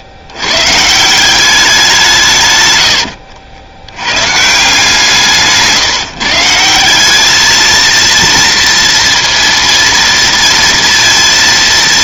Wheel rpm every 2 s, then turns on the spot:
120, 130, 160, 170, 230, 230.
2-4